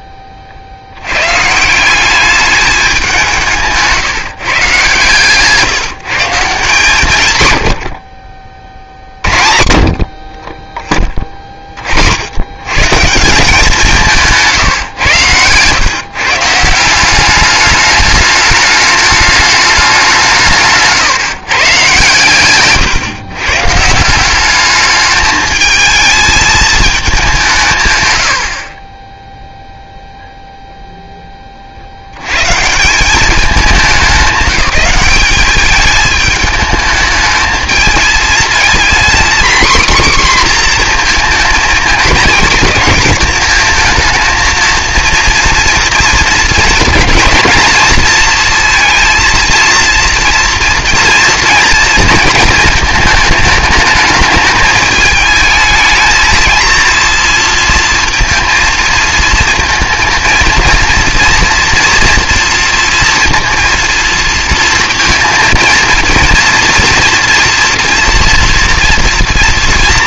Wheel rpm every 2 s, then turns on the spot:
50, 200, 140, 150, 60, 20, 130, 150, 170, 210, 160, 130, 210, 220, 40, 0, 150, 200, 220, 230, 250, 230, 230, 230, 230, 230, 220, 210, 230, 230, 230, 230, 230, 240, 230.
none